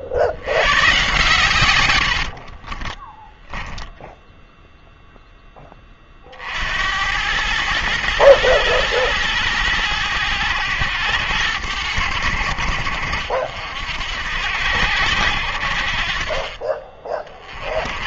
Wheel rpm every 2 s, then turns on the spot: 110, 30, 0, 70, 110, 100, 70, 80, 30.
2-4